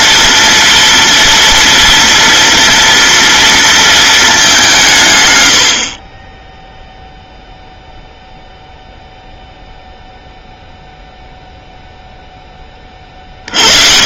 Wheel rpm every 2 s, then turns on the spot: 230, 230, 190, 0, 0, 0, 20.
none